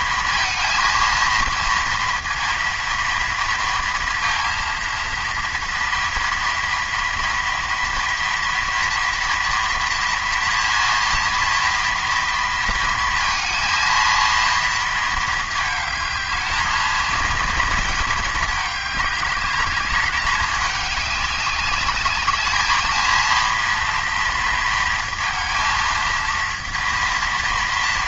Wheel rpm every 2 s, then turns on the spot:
230, 230, 230, 230, 230, 230, 230, 230, 220, 210, 200, 210, 230, 230.
none